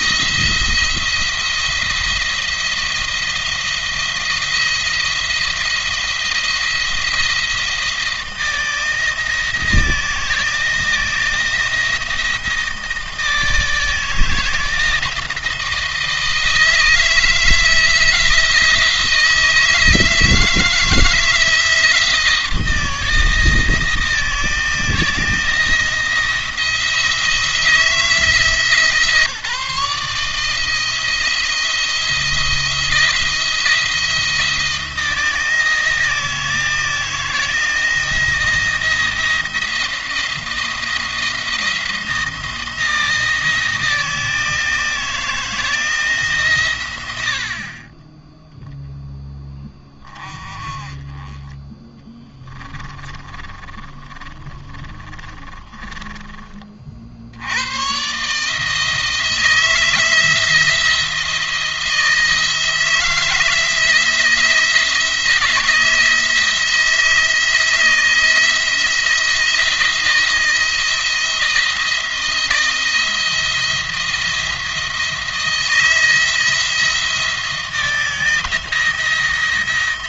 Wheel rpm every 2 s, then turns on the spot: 170, 170, 170, 170, 160, 170, 160, 160, 160, 170, 160, 170, 170, 170, 160, 160, 170, 170, 160, 160, 170, 160, 160, 130, 10, 40, 30, 30, 40, 150, 170, 160, 160, 160, 160, 170, 170, 170, 170, 160.
52-56